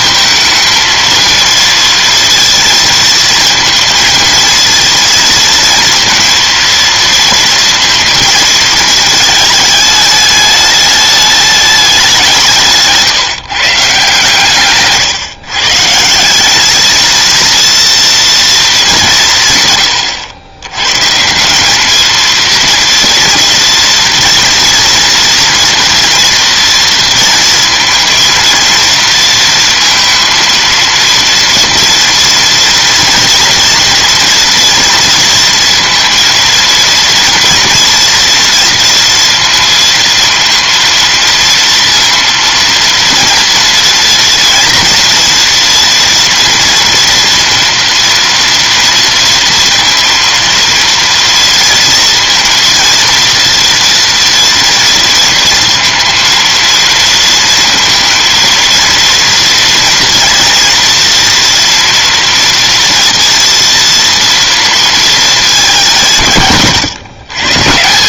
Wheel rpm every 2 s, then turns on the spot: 230, 230, 230, 230, 220, 210, 140, 140, 220, 190, 130, 230, 230, 230, 230, 230, 240, 240, 230, 230, 230, 230, 230, 230, 230, 230, 230, 230, 230, 230, 230, 230, 230, 150.
14-16